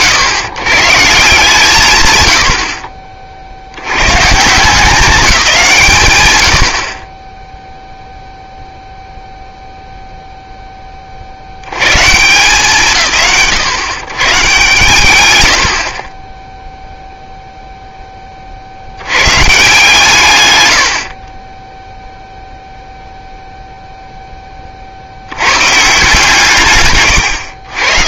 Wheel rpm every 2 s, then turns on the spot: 140, 70, 180, 70, 0, 0, 130, 100, 0, 50, 110, 0, 40, 160.
none